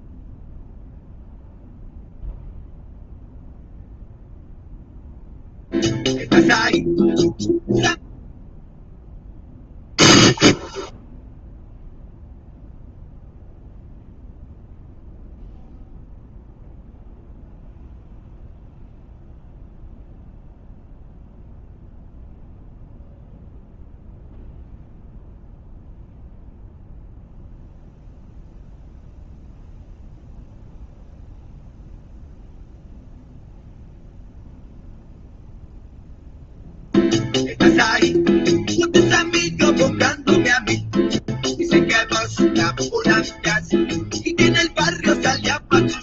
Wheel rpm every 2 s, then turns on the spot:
0, 0, 0, 0, 0, 0, 0, 0, 0, 0, 0, 0, 0, 0, 0, 0, 0, 0, 0, 0, 0, 0, 0.
none